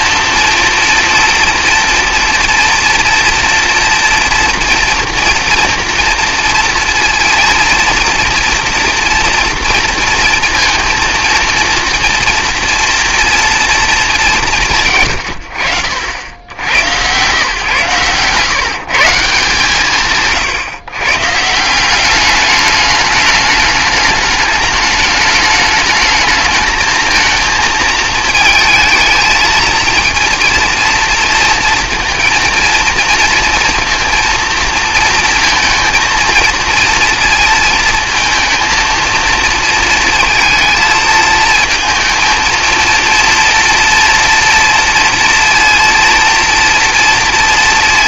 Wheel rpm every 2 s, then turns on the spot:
230, 230, 230, 230, 230, 230, 230, 110, 120, 160, 130, 210, 210, 220, 220, 230, 230, 230, 230, 230, 220, 230, 240, 240.
none